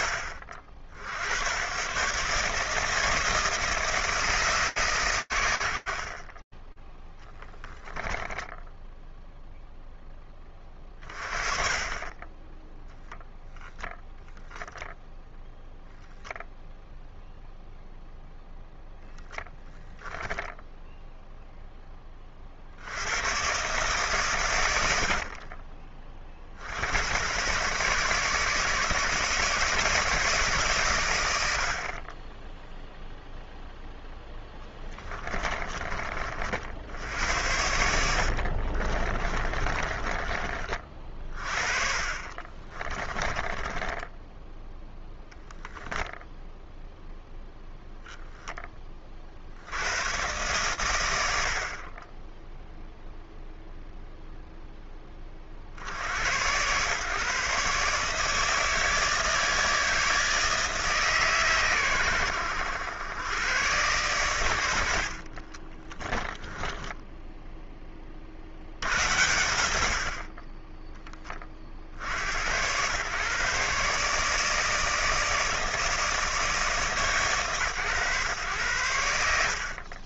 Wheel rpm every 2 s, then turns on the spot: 60, 160, 140, 10, 0, 40, 10, 0, 0, 0, 0, 90, 60, 90, 160, 110, 0, 20, 80, 30, 30, 20, 0, 0, 30, 100, 0, 0, 120, 160, 150, 90, 90, 10, 60, 30, 100, 160, 150, 100.
6-8 34-40 42-44 66-68